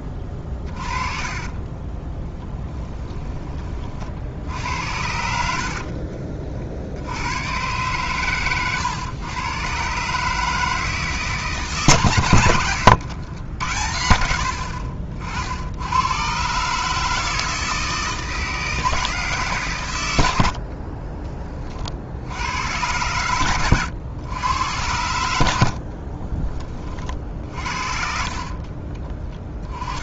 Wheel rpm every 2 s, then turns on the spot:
30, 10, 70, 60, 120, 160, 100, 60, 140, 160, 60, 100, 100, 30, 40.
0-4 12-14 20-22 28-30